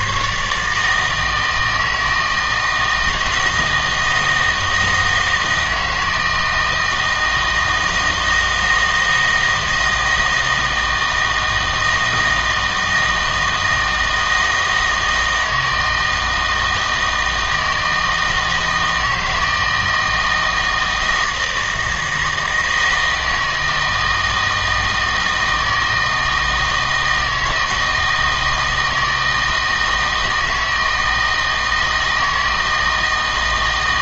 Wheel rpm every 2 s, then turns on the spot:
150, 160, 160, 160, 160, 160, 160, 160, 160, 160, 160, 160, 160, 160, 160, 160, 160.
none